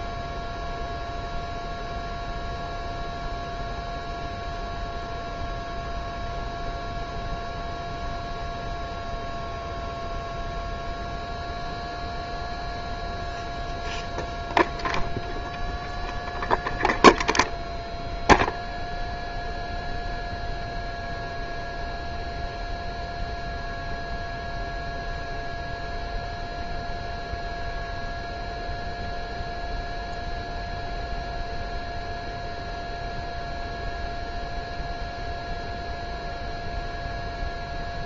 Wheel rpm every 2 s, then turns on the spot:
0, 0, 0, 0, 0, 0, 0, 0, 0, 0, 0, 0, 0, 0, 0, 0, 0, 0, 0.
none